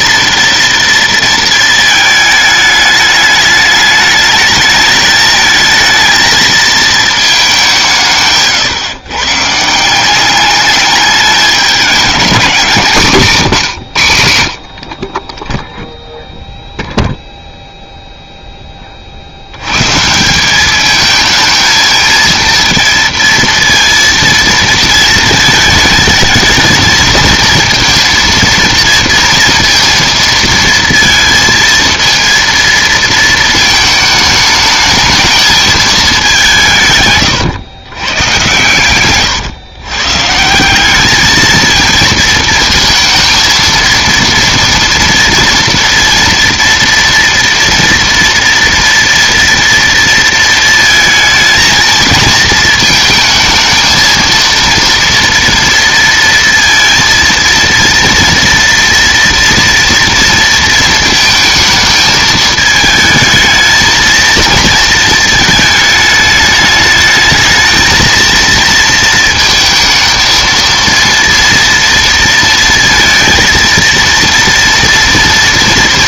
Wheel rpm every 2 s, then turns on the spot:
230, 220, 210, 220, 140, 200, 200, 60, 0, 10, 190, 230, 230, 220, 230, 230, 230, 220, 170, 120, 170, 220, 230, 230, 230, 230, 220, 230, 230, 230, 230, 220, 230, 210, 230, 230, 230, 230.
none